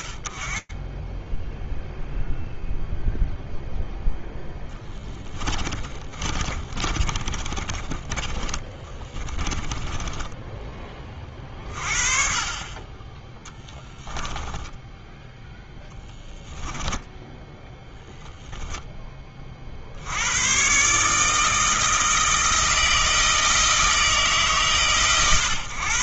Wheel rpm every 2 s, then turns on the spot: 0, 0, 30, 20, 10, 30, 10, 10, 10, 130, 160, 110, 60.
4-10 12-16